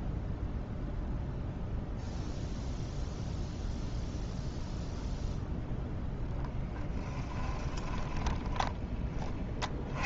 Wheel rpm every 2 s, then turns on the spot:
0, 0, 0, 10, 10.
6-10